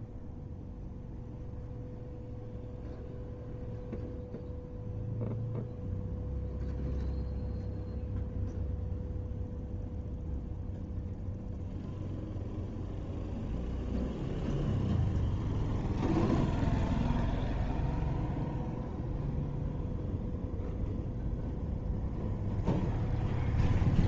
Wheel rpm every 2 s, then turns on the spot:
0, 0, 0, 0, 0, 0, 0, 0, 0, 0, 0, 0.
none